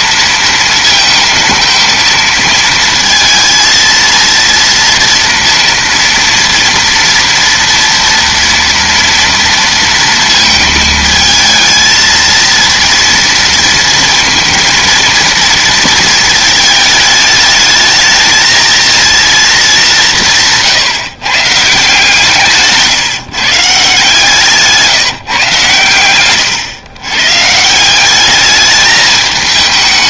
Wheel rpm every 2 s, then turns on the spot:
230, 230, 230, 230, 230, 220, 230, 230, 220, 220, 160, 150, 160, 120, 210.
22-24